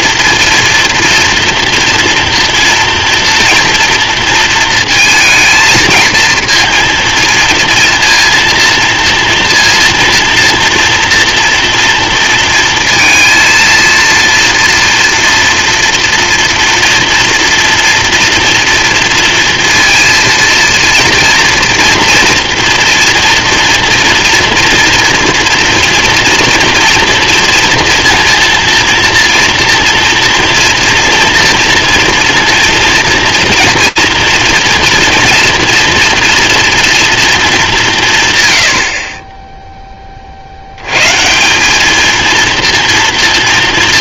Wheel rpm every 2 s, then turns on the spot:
230, 230, 230, 230, 230, 230, 230, 230, 240, 240, 230, 230, 230, 230, 230, 230, 230, 230, 230, 60, 120, 230.
none